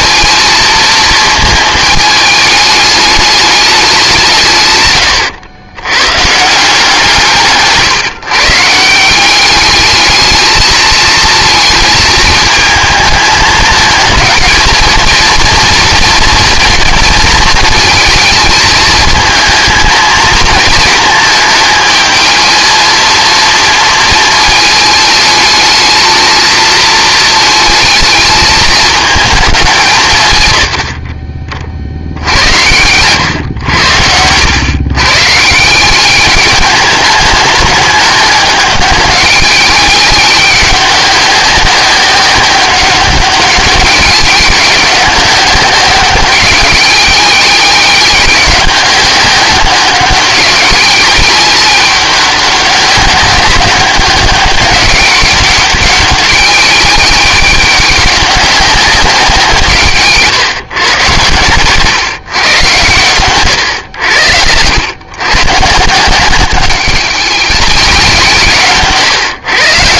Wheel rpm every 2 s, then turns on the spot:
220, 210, 120, 170, 170, 220, 220, 230, 220, 220, 220, 230, 220, 220, 220, 60, 110, 120, 210, 200, 190, 190, 200, 190, 190, 200, 200, 200, 200, 190, 140, 120, 100, 190, 140.
30-32 68-70